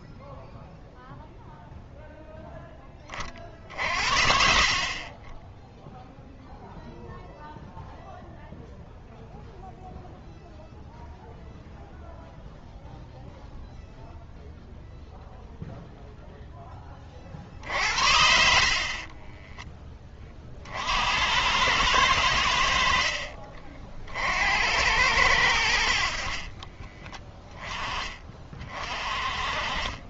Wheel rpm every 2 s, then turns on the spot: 0, 0, 40, 0, 0, 0, 0, 0, 10, 60, 40, 70, 80, 30, 40.
18-20 26-28